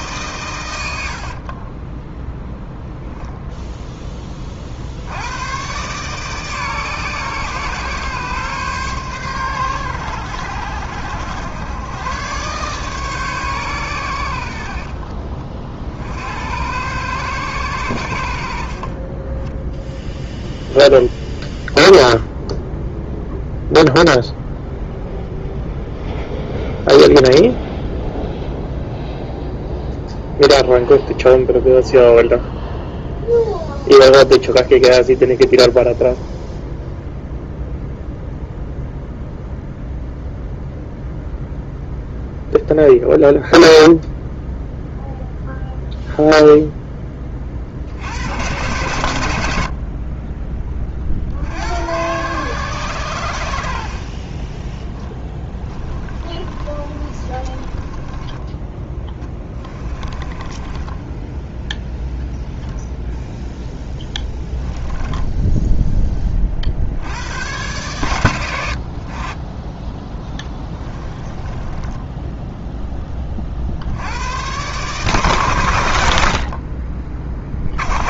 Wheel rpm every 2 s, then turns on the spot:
100, 0, 50, 140, 130, 80, 130, 60, 90, 50, 0, 0, 0, 0, 0, 0, 0, 0, 0, 0, 0, 0, 0, 0, 100, 30, 110, 10, 30, 10, 10, 0, 10, 40, 70, 10, 10, 130, 40.
56-58 60-62 70-72